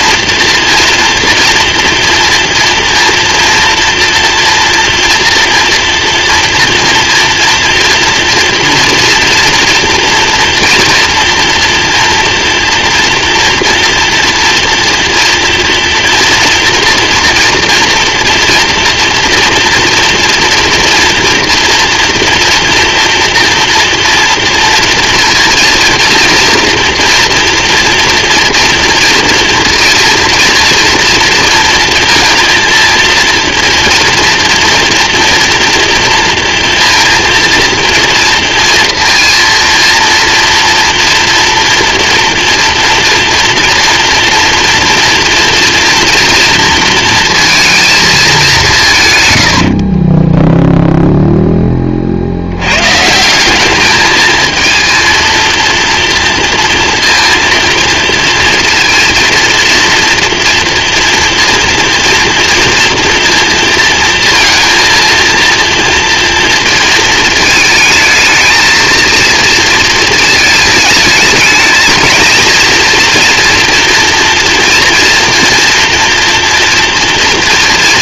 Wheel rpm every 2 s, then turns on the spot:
230, 230, 230, 230, 230, 230, 240, 240, 230, 240, 230, 230, 230, 230, 230, 230, 230, 230, 230, 230, 240, 230, 230, 230, 190, 0, 90, 220, 240, 230, 230, 230, 230, 230, 220, 220, 230, 230, 240.
none